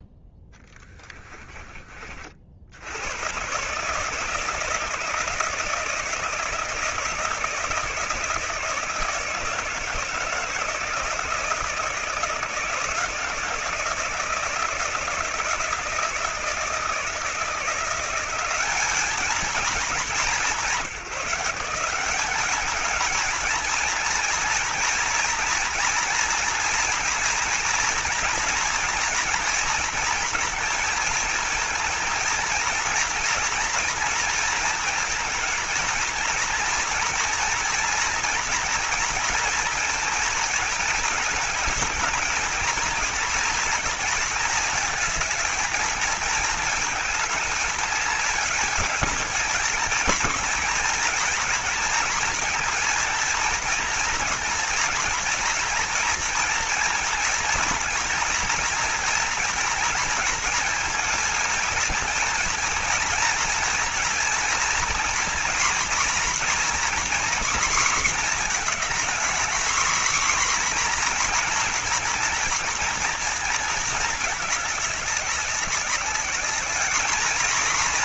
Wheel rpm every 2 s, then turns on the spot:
10, 70, 160, 160, 160, 160, 160, 160, 170, 200, 170, 200, 230, 240, 230, 230, 230, 230, 230, 230, 220, 230, 220, 220, 220, 230, 230, 230, 230, 230, 220, 230, 230, 240, 230, 250, 230, 200, 210.
0-2